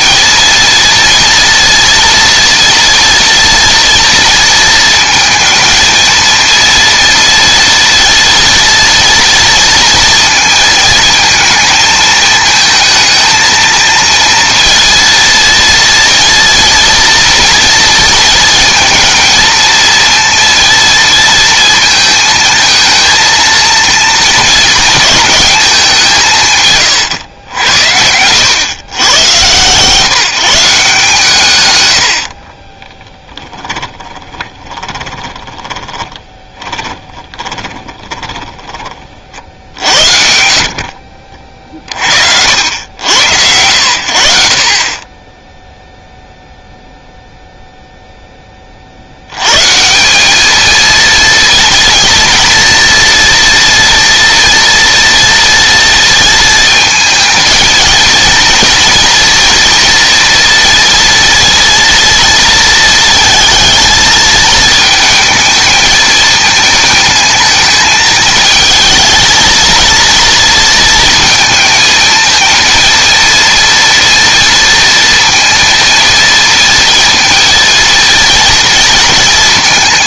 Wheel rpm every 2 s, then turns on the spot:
230, 240, 230, 230, 230, 220, 220, 230, 230, 230, 230, 220, 230, 120, 110, 150, 20, 20, 20, 30, 50, 90, 40, 0, 40, 230, 230, 230, 230, 230, 230, 230, 220, 220, 220, 230, 230, 230, 230, 230.
32-38